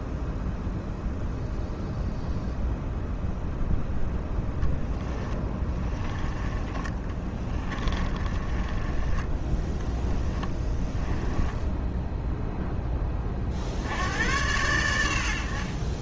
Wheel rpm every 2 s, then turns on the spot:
0, 0, 10, 20, 20, 10, 10, 90.
4-12